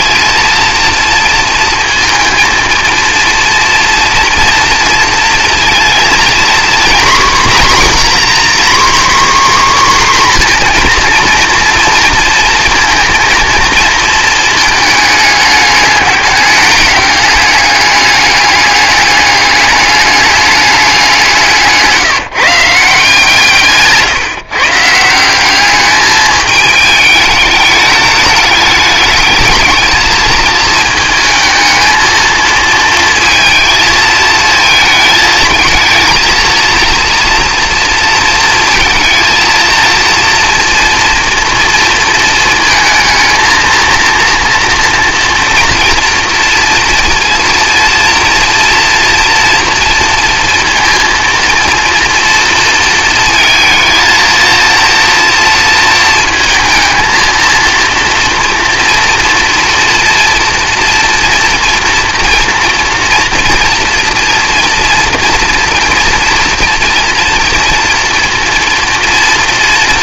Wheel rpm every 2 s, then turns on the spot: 230, 230, 230, 240, 260, 260, 230, 220, 200, 200, 200, 170, 150, 210, 210, 220, 220, 220, 230, 230, 230, 230, 230, 230, 240, 230, 230, 230, 220, 230, 230, 230, 230, 230, 230.
none